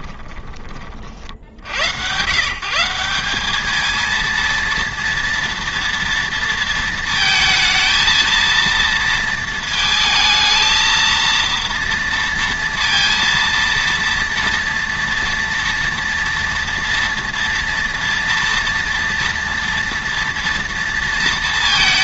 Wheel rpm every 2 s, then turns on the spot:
30, 160, 230, 230, 230, 220, 230, 230, 230, 230, 230.
none